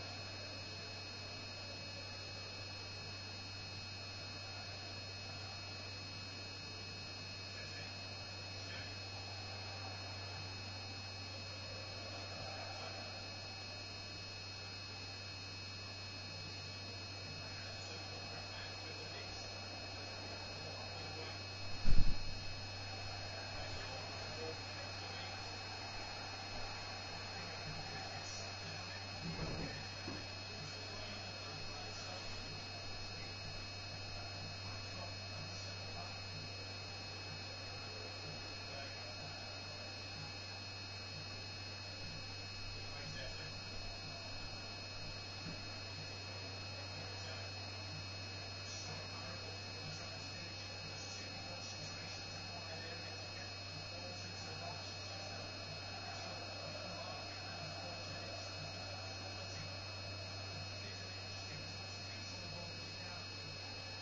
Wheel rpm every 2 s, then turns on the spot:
0, 0, 0, 0, 0, 0, 0, 0, 0, 0, 0, 0, 0, 0, 0, 0, 0, 0, 0, 0, 0, 0, 0, 0, 0, 0, 0, 0, 0, 0, 0, 0.
none